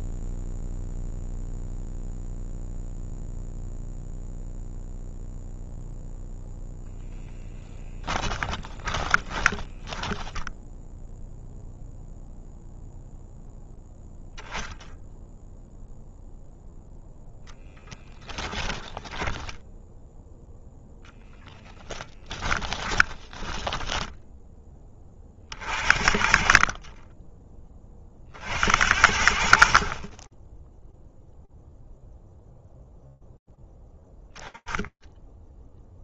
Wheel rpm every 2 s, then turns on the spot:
0, 0, 0, 0, 10, 10, 0, 10, 0, 10, 0, 20, 40, 20, 60, 0, 0, 0.
8-10 18-20 22-24